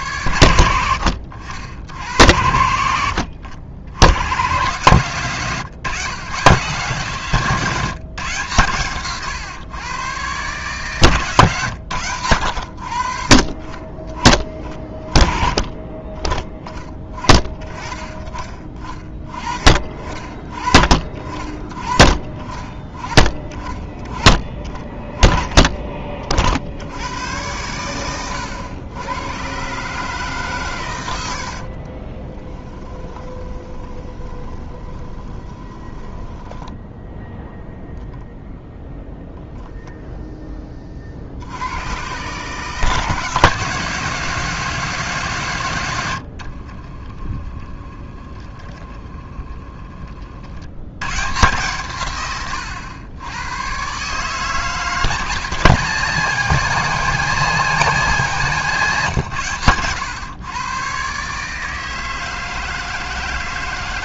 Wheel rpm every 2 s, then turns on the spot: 90, 80, 120, 140, 130, 130, 80, 20, 10, 40, 40, 30, 20, 60, 100, 120, 20, 20, 10, 0, 20, 150, 170, 60, 30, 90, 100, 160, 180, 160, 130, 160.
32-38 46-50